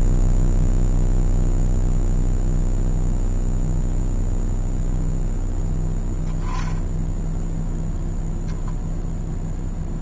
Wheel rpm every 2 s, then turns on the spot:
0, 0, 0, 0, 0.
none